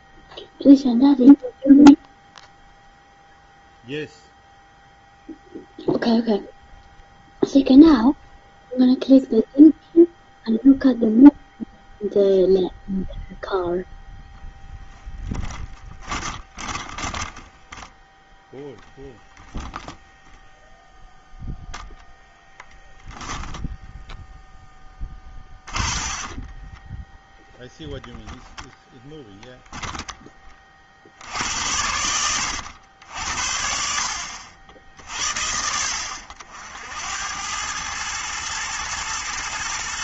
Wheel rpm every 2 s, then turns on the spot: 0, 0, 0, 0, 0, 0, 0, 0, 20, 10, 0, 10, 10, 10, 0, 50, 80, 90, 80, 110.
16-18 24-28